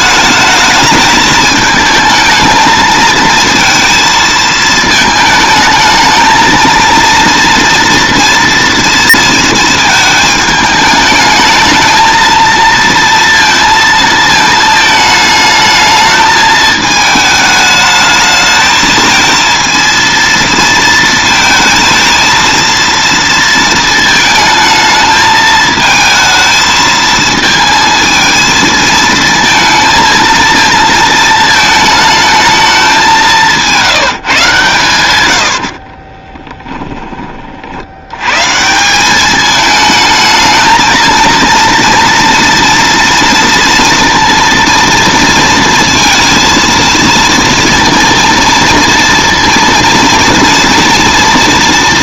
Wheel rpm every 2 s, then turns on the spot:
210, 220, 220, 230, 230, 210, 230, 220, 220, 220, 230, 230, 220, 220, 220, 220, 210, 140, 10, 160, 220, 230, 230, 230, 230, 230.
none